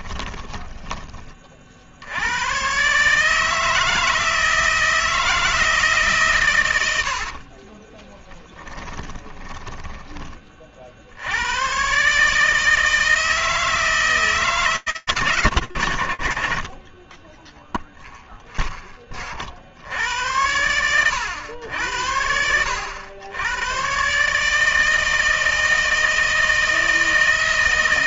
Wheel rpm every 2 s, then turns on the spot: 20, 100, 160, 140, 30, 20, 140, 160, 100, 0, 70, 70, 120, 160.
0-2 8-10